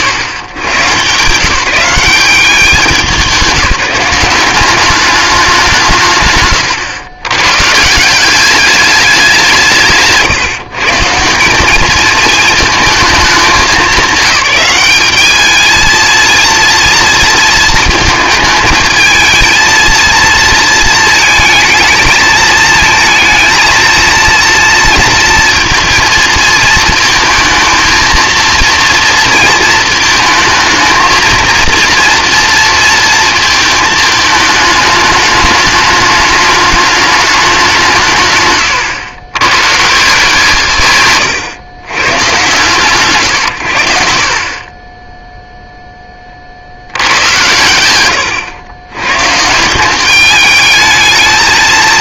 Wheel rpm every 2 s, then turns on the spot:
120, 190, 200, 110, 200, 150, 220, 200, 230, 220, 230, 230, 230, 230, 230, 230, 230, 210, 210, 120, 150, 120, 20, 70, 100, 210.
6-8 38-40